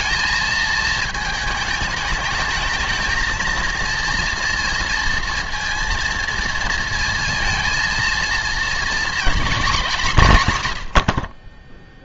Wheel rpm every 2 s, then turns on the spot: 220, 220, 230, 230, 230, 150.
none